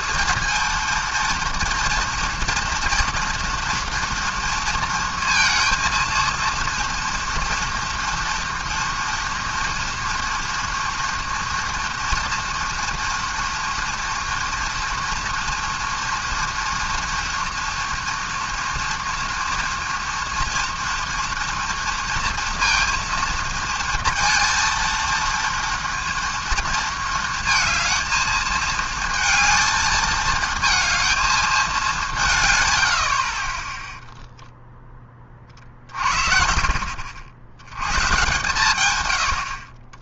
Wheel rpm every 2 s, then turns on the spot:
230, 230, 230, 230, 230, 230, 230, 230, 230, 230, 230, 230, 230, 230, 220, 220, 140, 0, 50, 120.
none